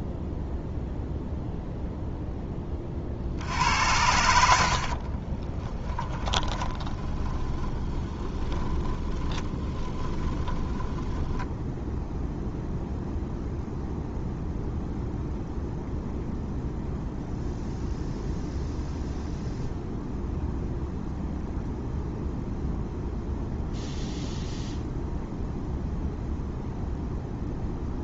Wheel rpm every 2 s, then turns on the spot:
0, 20, 60, 20, 20, 10, 0, 0, 0, 0, 0, 0, 0, 0.
4-12